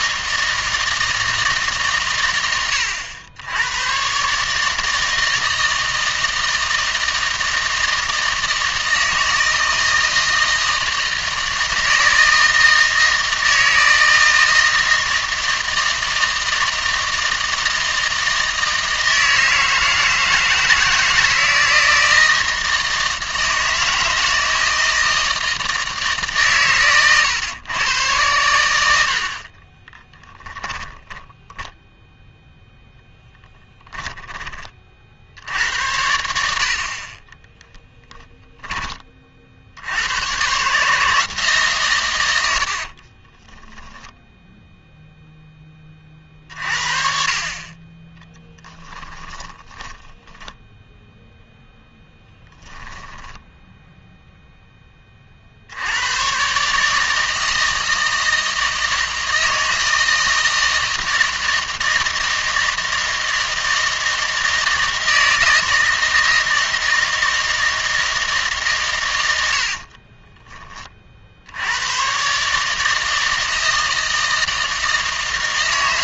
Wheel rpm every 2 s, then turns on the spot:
160, 100, 160, 160, 160, 160, 160, 160, 160, 160, 160, 160, 160, 120, 90, 10, 0, 40, 50, 20, 140, 50, 0, 50, 10, 0, 10, 10, 150, 160, 160, 160, 160, 160, 130, 20, 150, 160.
30-32 42-44 48-50 52-54